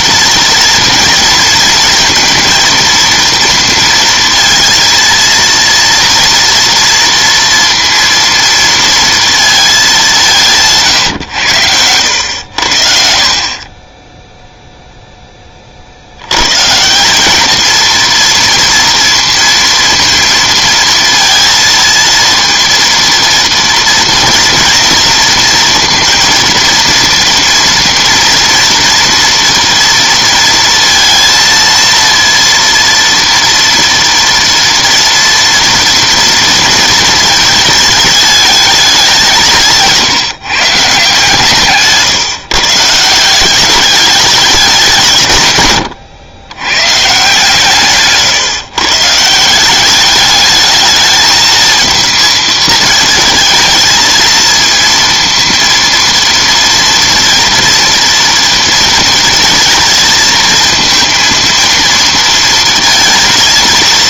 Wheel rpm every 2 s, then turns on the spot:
230, 230, 230, 230, 230, 160, 80, 0, 110, 230, 230, 230, 230, 230, 230, 230, 230, 230, 230, 210, 150, 150, 200, 100, 140, 210, 220, 230, 230, 230, 230, 230.
none